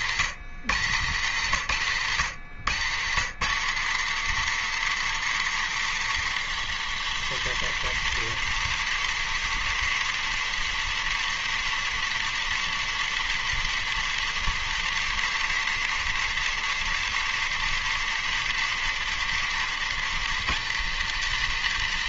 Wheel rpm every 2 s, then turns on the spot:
140, 170, 240, 240, 240, 240, 240, 240, 240, 240, 240.
none